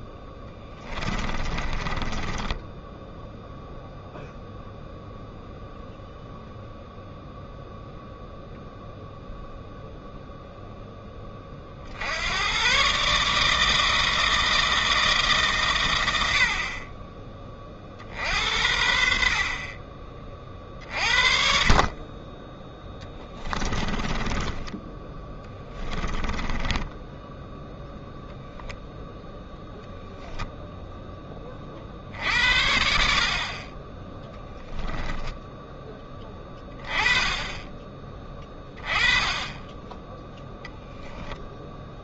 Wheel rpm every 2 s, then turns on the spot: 20, 10, 0, 0, 0, 10, 130, 160, 30, 60, 40, 10, 10, 10, 0, 10, 60, 10, 20, 20, 0.
0-4 24-28